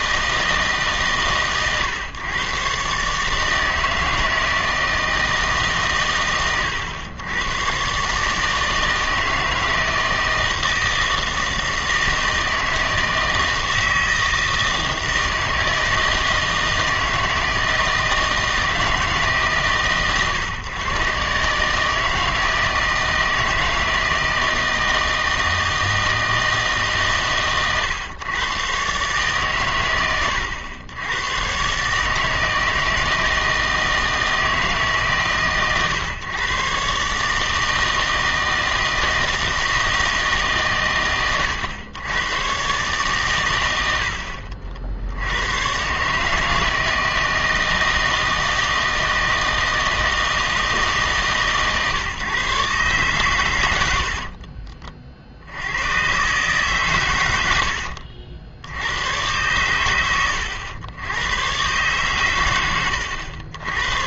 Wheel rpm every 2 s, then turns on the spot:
150, 130, 160, 100, 160, 160, 160, 160, 160, 160, 130, 160, 160, 160, 130, 100, 160, 150, 130, 160, 130, 130, 60, 160, 160, 160, 140, 40, 140, 90, 90, 100.
none